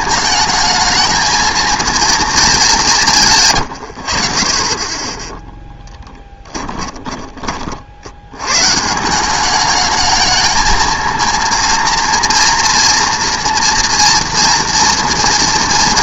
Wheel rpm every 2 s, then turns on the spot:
210, 220, 50, 10, 120, 220, 230, 230.
6-8